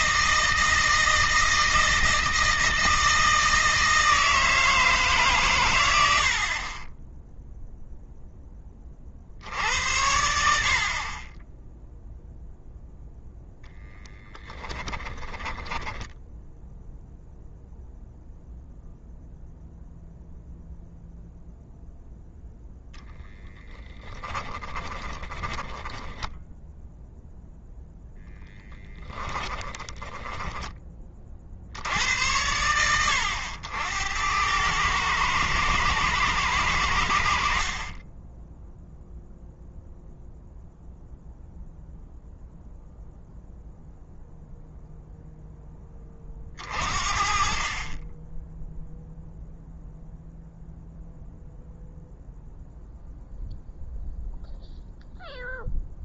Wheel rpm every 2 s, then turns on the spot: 160, 160, 160, 20, 50, 40, 0, 20, 0, 0, 0, 0, 20, 0, 10, 30, 90, 110, 90, 0, 0, 0, 0, 50, 0, 0, 0, 0.
14-16 24-26 28-30